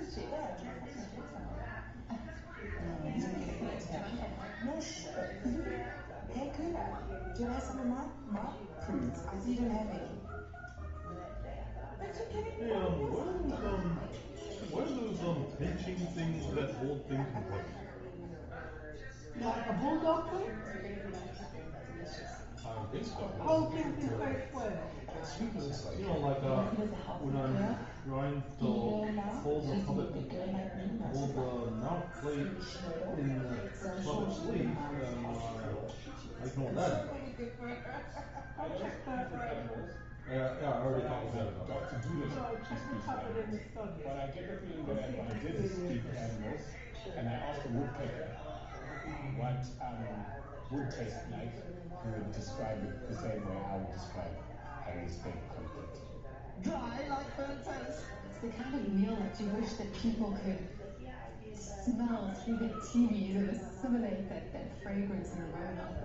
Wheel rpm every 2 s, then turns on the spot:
0, 0, 0, 0, 0, 0, 0, 0, 0, 0, 0, 0, 0, 0, 0, 0, 0, 0, 0, 0, 0, 0, 0, 0, 0, 0, 0, 0, 0, 0, 0, 0, 0.
none